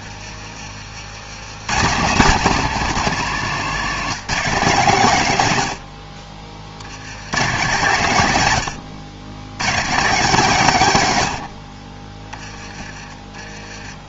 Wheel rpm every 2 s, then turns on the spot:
40, 190, 170, 50, 120, 160, 20.
12-14